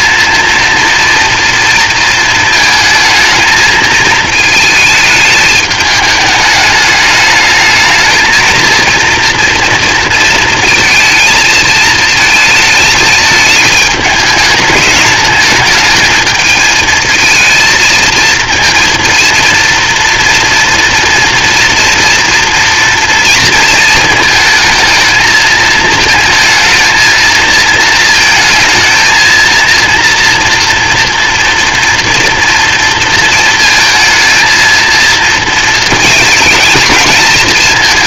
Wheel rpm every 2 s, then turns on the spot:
230, 220, 220, 210, 230, 230, 220, 210, 220, 230, 230, 230, 220, 220, 230, 240, 230, 230, 210.
none